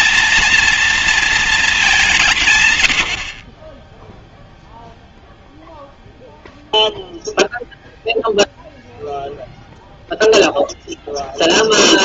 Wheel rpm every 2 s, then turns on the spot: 230, 170, 0, 0, 0, 0.
none